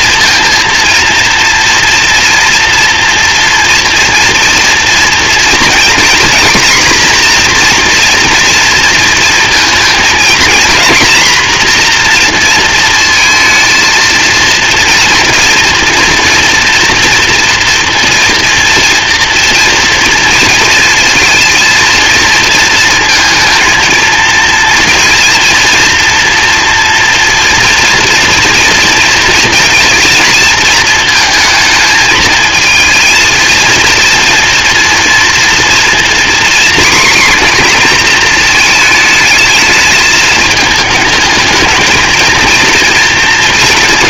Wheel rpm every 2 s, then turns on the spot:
230, 240, 240, 250, 230, 230, 230, 230, 240, 230, 230, 230, 230, 230, 230, 220, 220, 230, 250, 220, 210, 230.
none